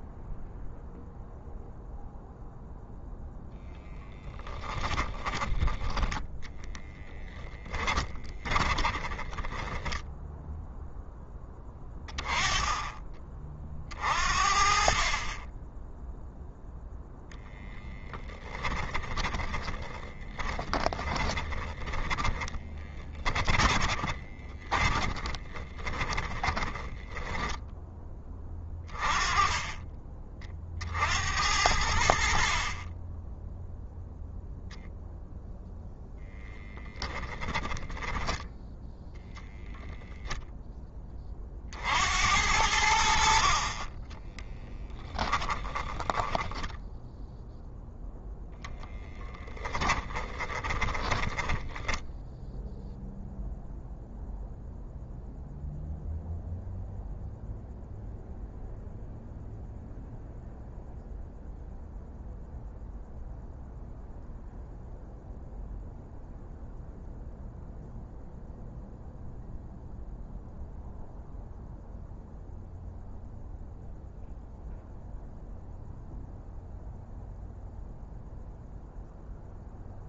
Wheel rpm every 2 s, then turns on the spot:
0, 0, 10, 10, 10, 0, 20, 40, 0, 20, 20, 20, 30, 20, 30, 60, 30, 0, 10, 0, 20, 60, 10, 0, 10, 20, 0, 0, 0, 0, 0, 0, 0, 0, 0, 0, 0, 0, 0, 0.
6-10 18-28 36-38 44-46 50-52